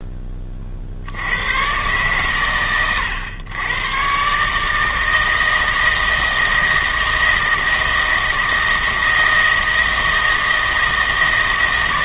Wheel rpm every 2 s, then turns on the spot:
50, 120, 150, 160, 160, 160.
none